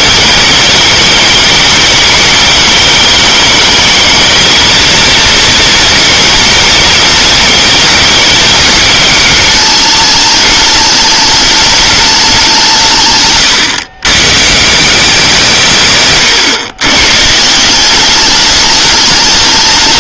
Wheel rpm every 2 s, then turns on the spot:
220, 210, 230, 230, 220, 210, 170, 150, 130, 210.
none